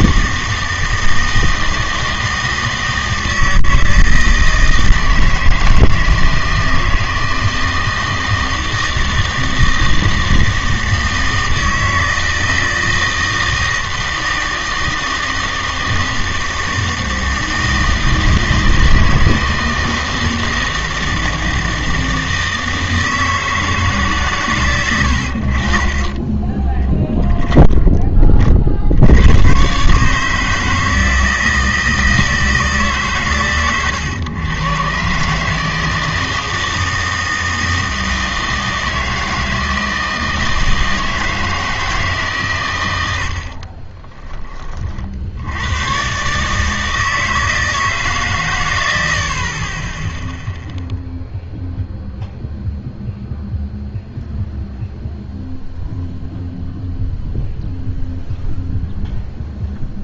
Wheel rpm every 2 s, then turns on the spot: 160, 160, 160, 160, 160, 160, 160, 160, 160, 160, 160, 160, 110, 10, 50, 160, 160, 120, 160, 160, 160, 130, 30, 150, 110, 0, 0, 0, 0, 0.
26-28